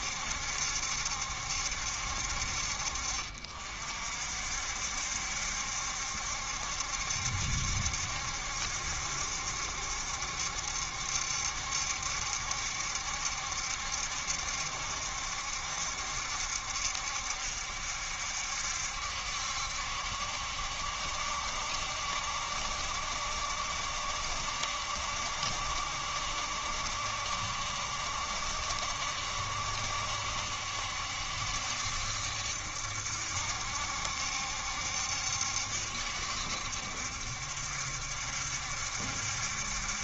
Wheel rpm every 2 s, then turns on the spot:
70, 50, 60, 70, 70, 70, 70, 70, 70, 70, 70, 70, 70, 70, 70, 70, 70, 70, 70, 70.
none